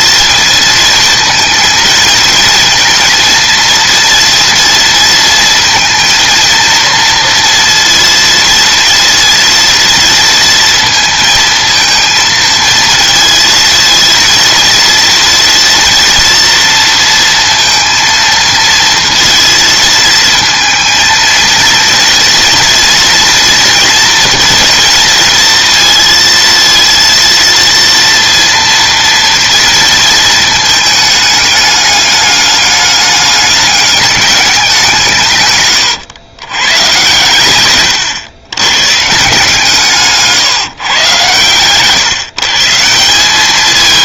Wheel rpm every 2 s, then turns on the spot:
230, 230, 230, 230, 230, 230, 220, 230, 230, 230, 230, 230, 230, 230, 230, 220, 210, 180, 130, 130, 130, 170.
none